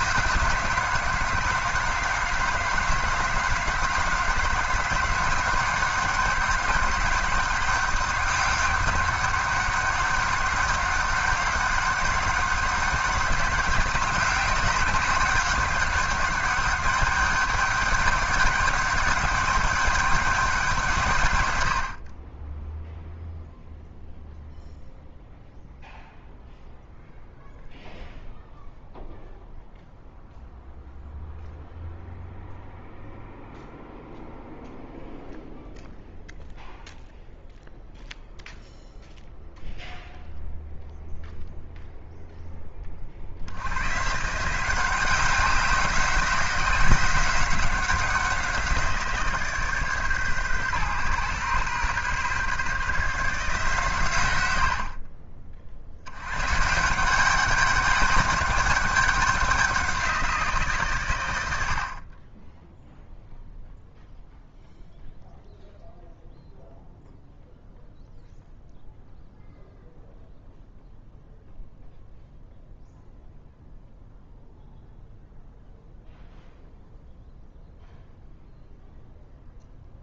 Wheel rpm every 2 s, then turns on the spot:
190, 190, 190, 190, 190, 190, 200, 190, 200, 200, 180, 10, 0, 0, 0, 0, 0, 0, 0, 0, 0, 20, 180, 180, 170, 130, 150, 80, 150, 200, 150, 0, 0, 0, 0, 0, 0, 0, 0, 0.
none